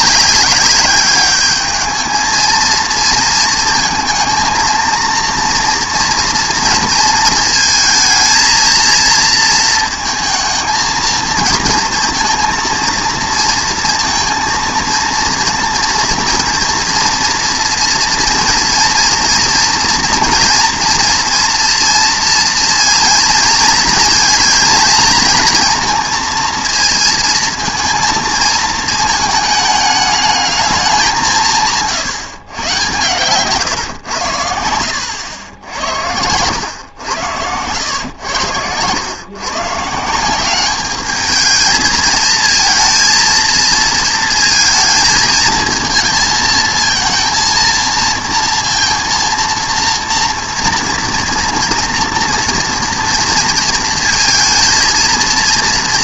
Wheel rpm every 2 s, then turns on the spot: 200, 220, 230, 230, 230, 230, 230, 230, 230, 240, 230, 230, 230, 230, 220, 210, 110, 90, 110, 100, 200, 230, 220, 220, 230, 240, 230, 230.
none